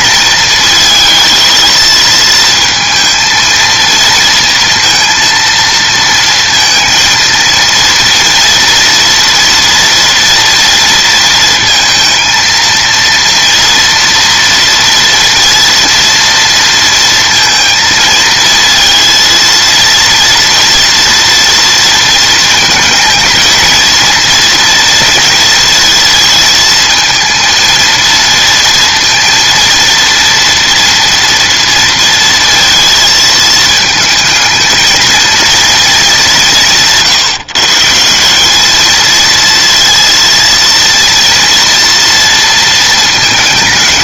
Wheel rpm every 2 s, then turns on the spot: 220, 220, 230, 230, 230, 230, 230, 240, 230, 230, 230, 220, 230, 220, 230, 230, 230, 220, 170, 220, 230, 230.
none